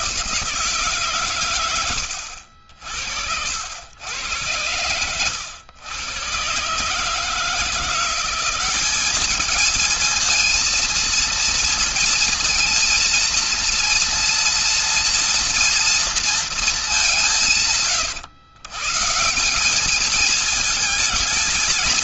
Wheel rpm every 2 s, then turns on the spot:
170, 70, 100, 120, 190, 230, 230, 230, 230, 120, 220.
none